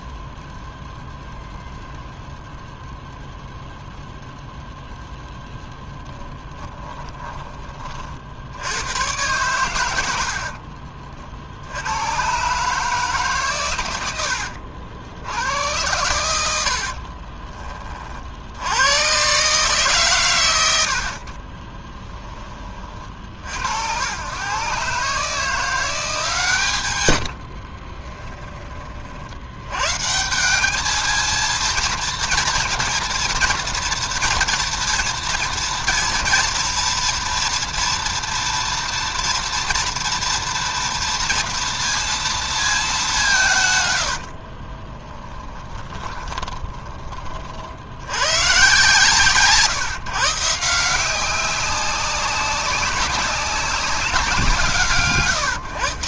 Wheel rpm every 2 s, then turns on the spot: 0, 0, 0, 10, 90, 50, 150, 70, 60, 100, 70, 40, 130, 120, 40, 210, 230, 230, 230, 230, 230, 210, 20, 20, 130, 170, 190, 140.
6-8 16-18 44-46